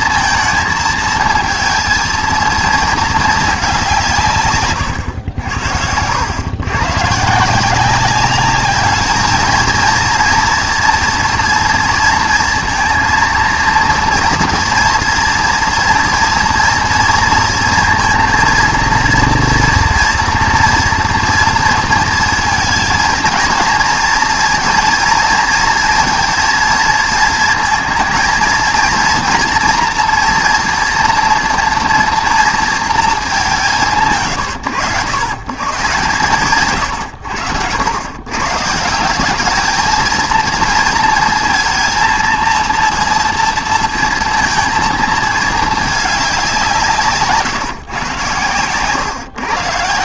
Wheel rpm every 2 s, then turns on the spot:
220, 220, 140, 120, 210, 230, 230, 230, 230, 230, 230, 230, 230, 230, 230, 240, 230, 90, 130, 170, 230, 230, 230, 180, 110.
4-6